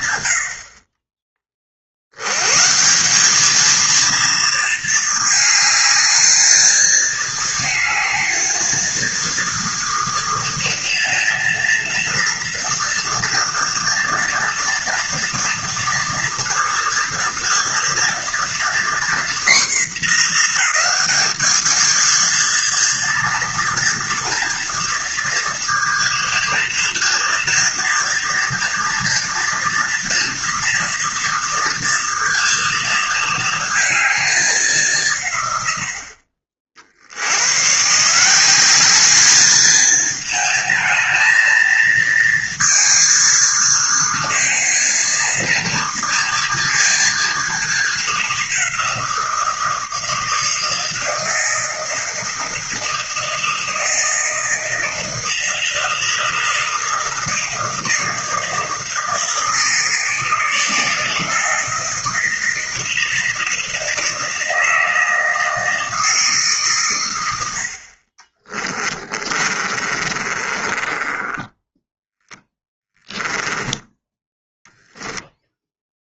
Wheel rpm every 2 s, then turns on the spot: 100, 110, 230, 220, 230, 230, 230, 230, 230, 240, 230, 230, 230, 230, 230, 230, 230, 210, 50, 180, 220, 230, 230, 230, 210, 160, 160, 160, 160, 160, 160, 160, 160, 150, 50, 30, 10, 10.
68-74